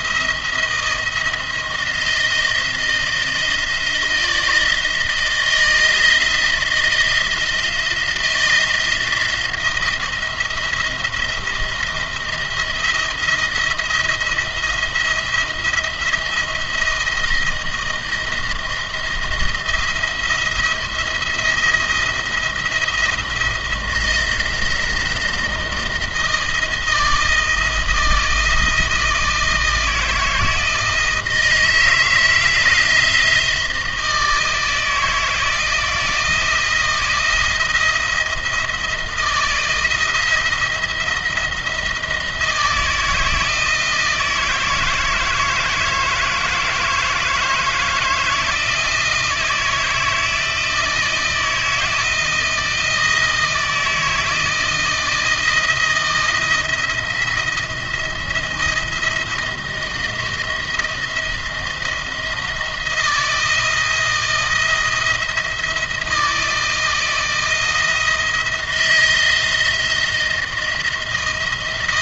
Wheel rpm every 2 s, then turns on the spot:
170, 160, 160, 160, 170, 160, 170, 170, 170, 170, 170, 170, 170, 160, 160, 160, 160, 160, 170, 160, 170, 160, 160, 160, 160, 170, 160, 160, 170, 170, 170, 160, 170, 160, 160, 170.
none